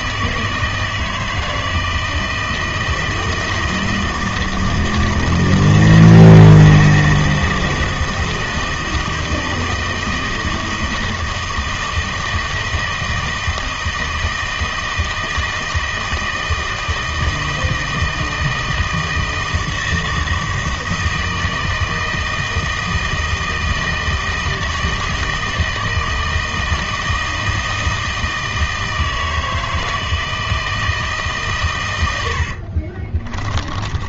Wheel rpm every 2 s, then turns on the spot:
160, 160, 160, 160, 160, 160, 160, 160, 160, 160, 160, 160, 160, 160, 160, 160, 60.
32-34